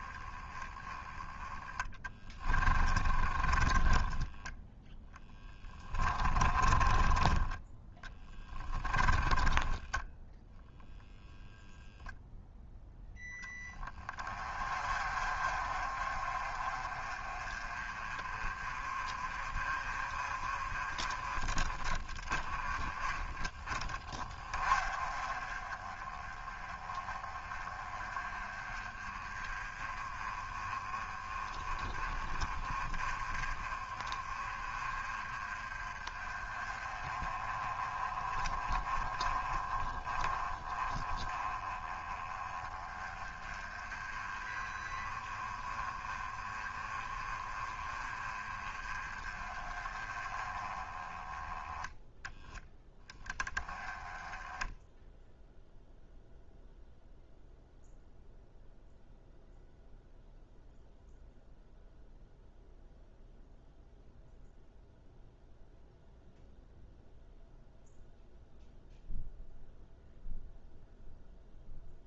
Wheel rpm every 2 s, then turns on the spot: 10, 20, 10, 20, 30, 0, 0, 30, 30, 30, 30, 30, 30, 20, 20, 20, 20, 30, 20, 20, 20, 20, 20, 30, 20, 20, 10, 0, 0, 0, 0, 0, 0, 0, 0, 0.
2-4 6-10